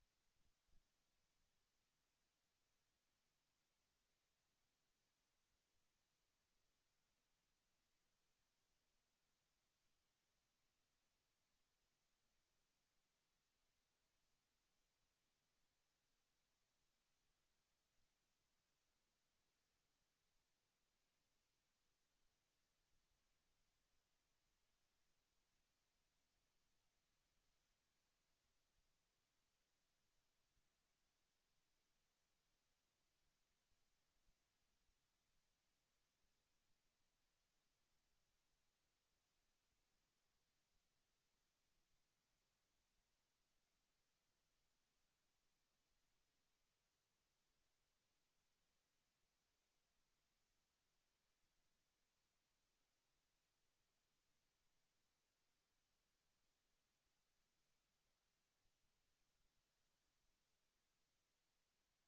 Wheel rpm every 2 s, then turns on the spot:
0, 0, 0, 0, 0, 0, 0, 0, 0, 0, 0, 0, 0, 0, 0, 0, 0, 0, 0, 0, 0, 0, 0, 0, 0, 0, 0, 0, 0, 0, 0.
none